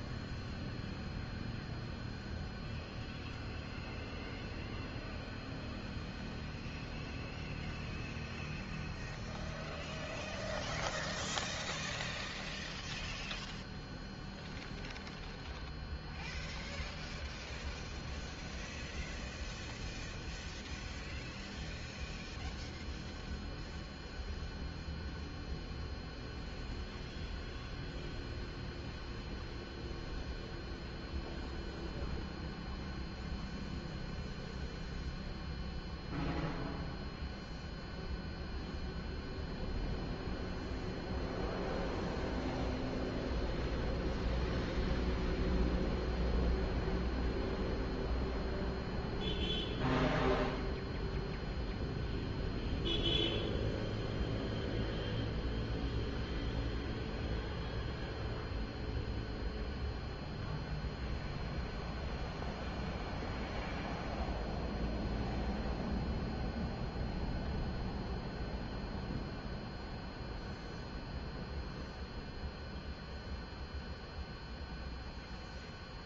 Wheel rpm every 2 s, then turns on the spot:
0, 0, 0, 0, 0, 0, 0, 0, 0, 0, 0, 0, 0, 0, 0, 0, 0, 0, 0, 0, 0, 0, 0, 0, 0, 0, 0, 0, 0, 0, 0, 0, 0, 0, 0, 0, 0, 0.
none